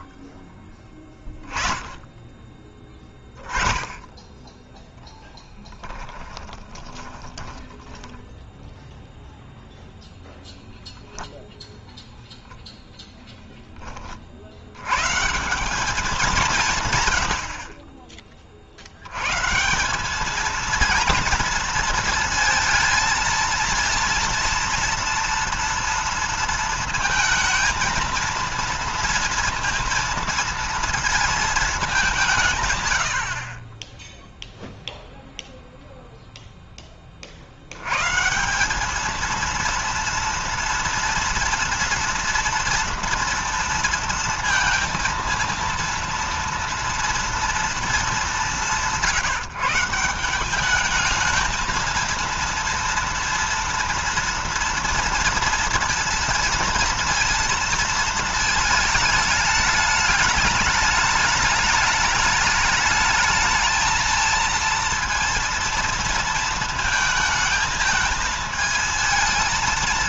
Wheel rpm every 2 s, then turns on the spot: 20, 20, 10, 20, 0, 0, 0, 70, 170, 50, 220, 230, 230, 230, 230, 230, 140, 0, 10, 180, 230, 230, 230, 230, 190, 200, 230, 230, 230, 220, 210, 210, 230, 230, 220.
6-8